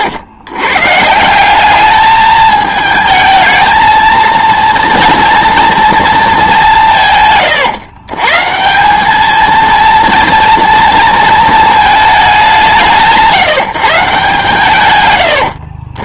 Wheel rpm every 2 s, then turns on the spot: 130, 220, 230, 180, 170, 230, 180, 130.
none